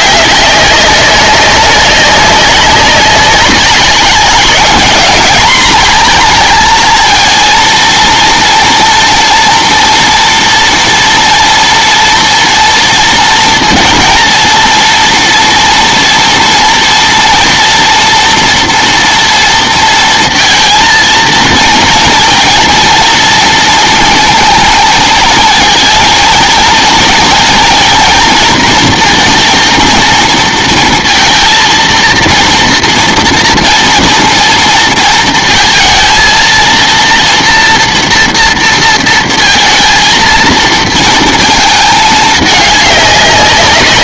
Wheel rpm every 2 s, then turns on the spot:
200, 200, 200, 230, 240, 230, 230, 230, 230, 230, 230, 230, 230, 230, 230, 230, 230, 230, 230, 230, 230, 210.
none